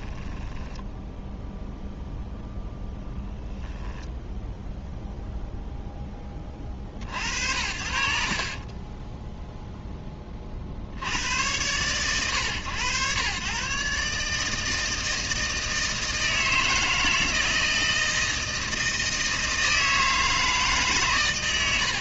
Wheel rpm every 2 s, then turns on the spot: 10, 10, 0, 60, 30, 20, 110, 160, 160, 160, 150.
0-2 8-10